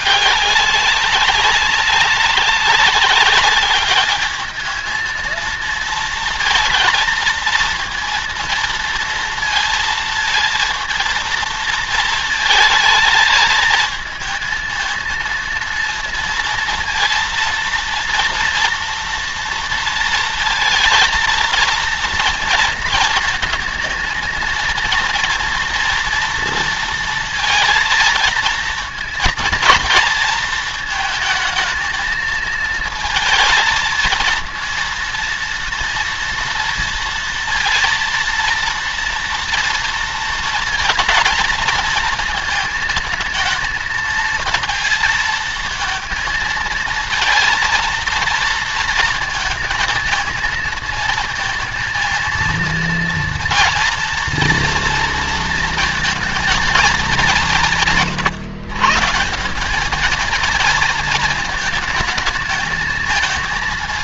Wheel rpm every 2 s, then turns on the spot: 200, 200, 220, 230, 230, 230, 220, 230, 230, 230, 230, 220, 230, 230, 230, 220, 230, 230, 230, 230, 230, 220, 230, 230, 230, 220, 230, 230, 200, 160, 220, 220.
none